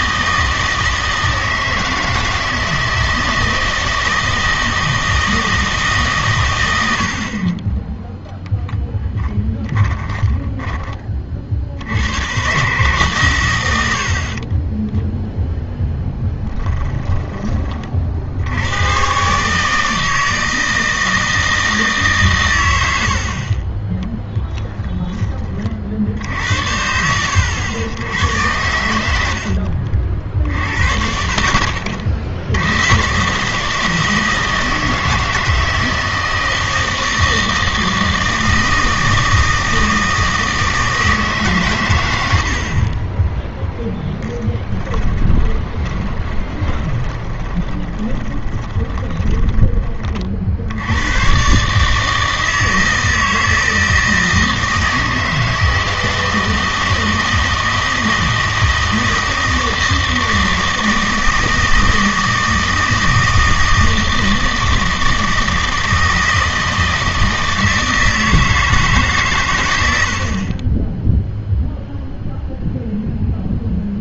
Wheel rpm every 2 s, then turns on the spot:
160, 160, 160, 110, 10, 10, 120, 20, 10, 90, 160, 100, 10, 70, 90, 60, 110, 160, 160, 160, 160, 40, 10, 20, 20, 80, 160, 160, 160, 160, 160, 160, 160, 160, 160, 30, 0.
14-18 28-30 44-50